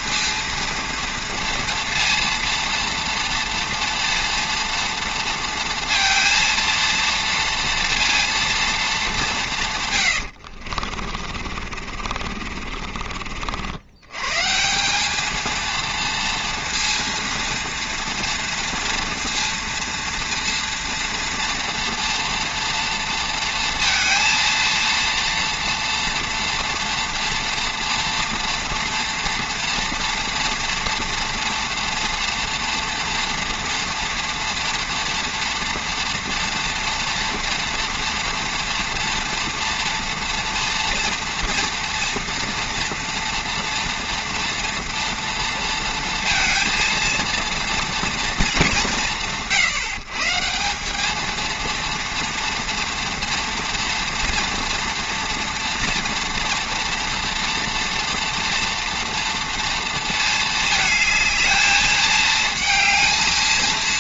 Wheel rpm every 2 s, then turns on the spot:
230, 230, 230, 230, 220, 60, 50, 160, 230, 230, 230, 230, 230, 230, 230, 230, 230, 230, 230, 230, 230, 230, 230, 230, 190, 180, 230, 240, 230, 230, 220, 220.
10-14